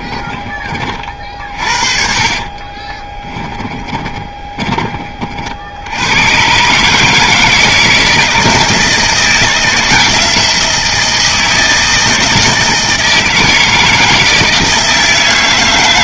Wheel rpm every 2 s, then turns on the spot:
40, 20, 30, 140, 160, 170, 160, 160.
2-4